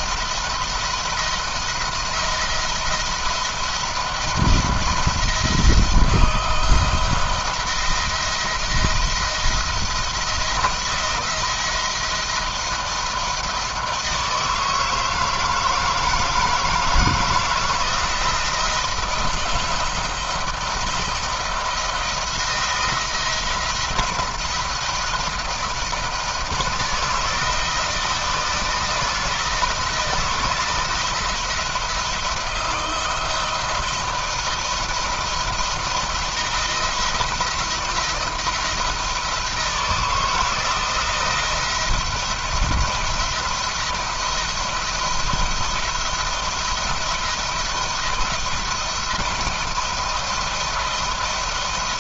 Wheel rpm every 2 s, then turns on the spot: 170, 170, 170, 170, 170, 170, 160, 160, 160, 170, 170, 160, 170, 160, 160, 170, 170, 170, 170, 160, 170, 170, 170, 160, 170, 170.
none